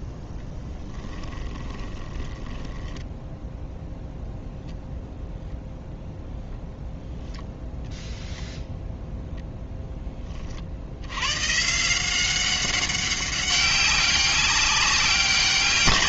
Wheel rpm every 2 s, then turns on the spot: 10, 20, 0, 0, 0, 40, 190, 190.
0-4